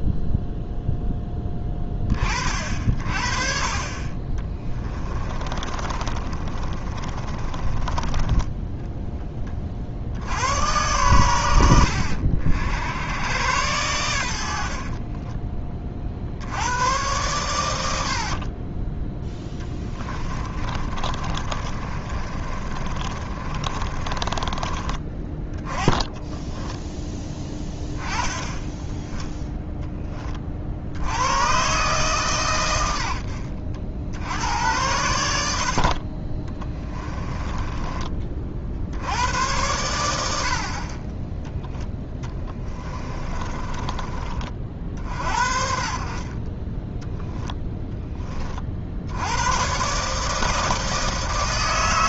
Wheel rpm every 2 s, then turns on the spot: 0, 50, 20, 40, 10, 100, 80, 60, 90, 30, 30, 30, 30, 10, 10, 70, 110, 90, 20, 60, 50, 20, 50, 20, 50, 160.
4-8 14-16 20-28 36-38 42-44